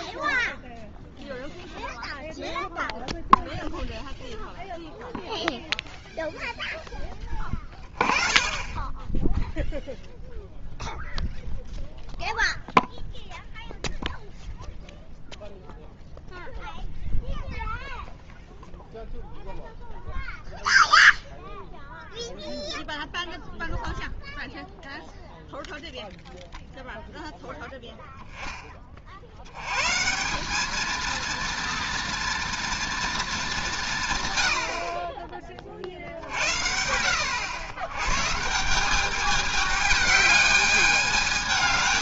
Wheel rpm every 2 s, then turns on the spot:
0, 0, 0, 0, 20, 0, 0, 0, 0, 0, 0, 0, 0, 0, 30, 210, 240, 50, 80, 170, 210.
none